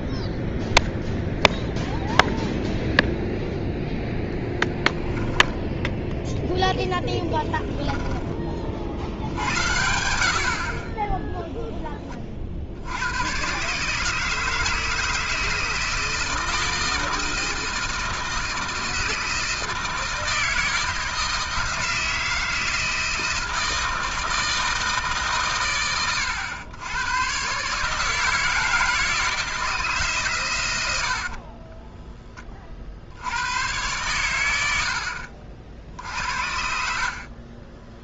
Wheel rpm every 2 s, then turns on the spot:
0, 0, 10, 10, 20, 70, 40, 160, 160, 160, 160, 160, 160, 100, 160, 130, 20, 90, 60.
none